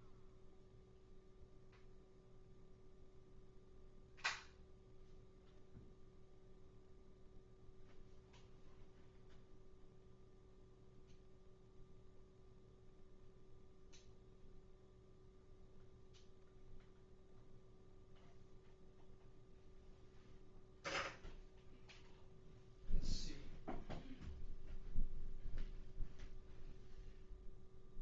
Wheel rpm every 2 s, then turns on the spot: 0, 0, 0, 0, 0, 0, 0, 0, 0, 0, 0, 0, 0, 0.
none